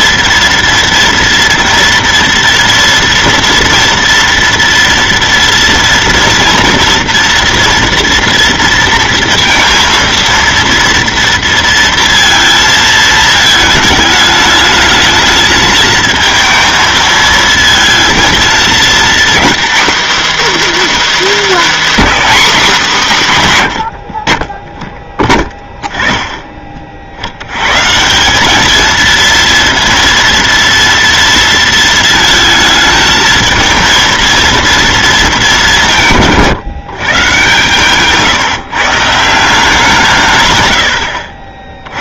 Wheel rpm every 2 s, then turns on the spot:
230, 230, 240, 230, 230, 230, 230, 210, 220, 230, 330, 270, 20, 30, 210, 230, 220, 230, 160, 150, 110.
none